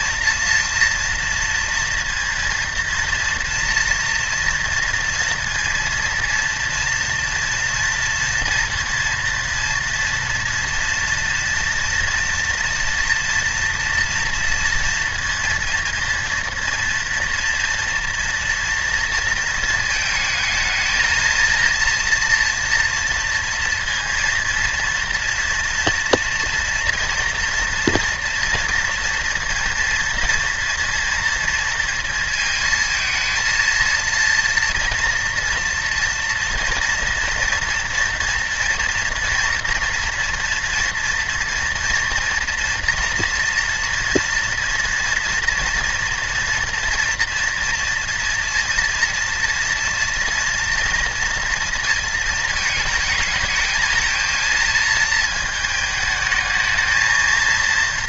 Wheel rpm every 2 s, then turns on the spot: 230, 230, 230, 230, 230, 230, 230, 230, 230, 230, 220, 230, 230, 240, 230, 230, 230, 230, 240, 230, 230, 240, 230, 230, 230, 230, 220, 220, 220.
none